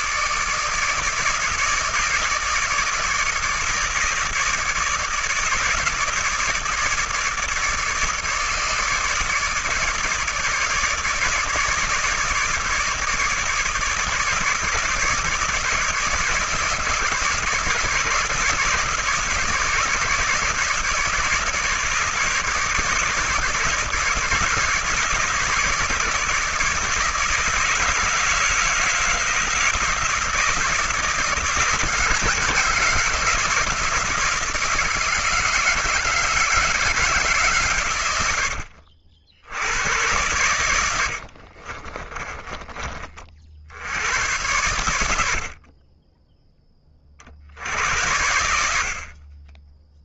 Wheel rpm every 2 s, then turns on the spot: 160, 160, 160, 160, 150, 150, 160, 150, 150, 150, 150, 160, 140, 150, 160, 160, 160, 160, 160, 80, 100, 30, 100, 10, 80.
42-44